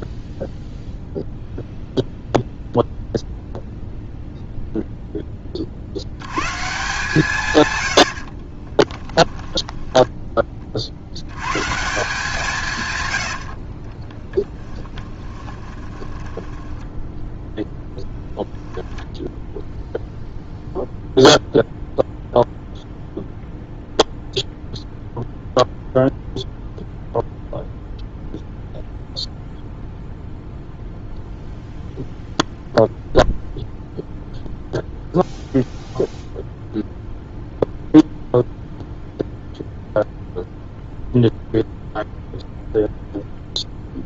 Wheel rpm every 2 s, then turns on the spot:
0, 0, 0, 160, 20, 50, 150, 10, 10, 0, 0, 0, 0, 0, 0, 0, 0, 0, 0, 0, 0, 0.
8-10 14-18